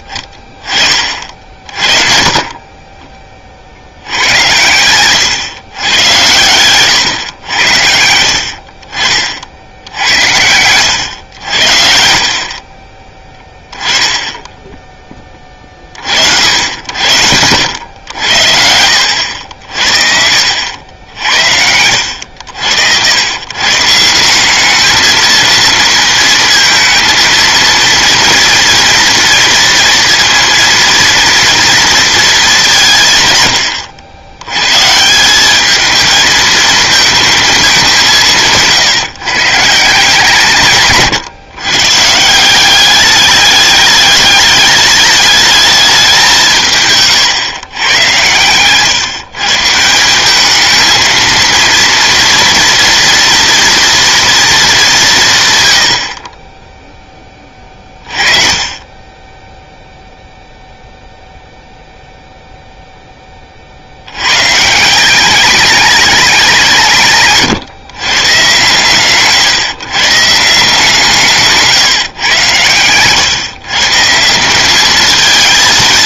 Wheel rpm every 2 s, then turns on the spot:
30, 30, 100, 110, 60, 110, 40, 10, 80, 70, 80, 80, 210, 220, 230, 230, 190, 120, 220, 160, 150, 190, 210, 160, 120, 210, 230, 210, 10, 30, 0, 0, 150, 180, 130, 160, 110, 190.
72-74